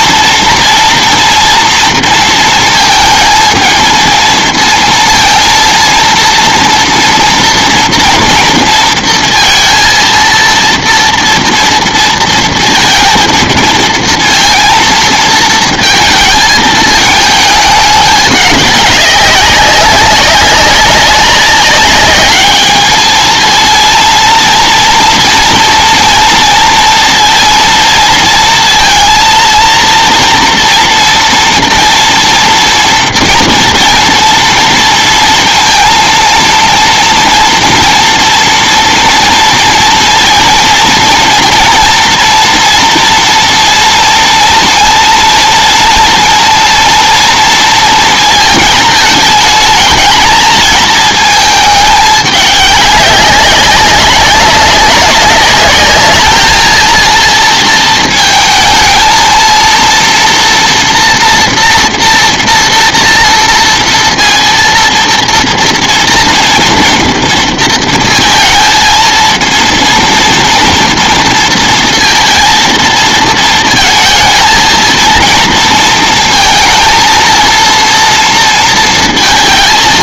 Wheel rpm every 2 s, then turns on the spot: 230, 220, 230, 230, 230, 230, 230, 230, 220, 200, 200, 210, 230, 230, 230, 240, 230, 230, 230, 230, 230, 230, 230, 230, 220, 220, 200, 200, 220, 220, 230, 230, 230, 230, 230, 230, 230, 220, 230, 230.
none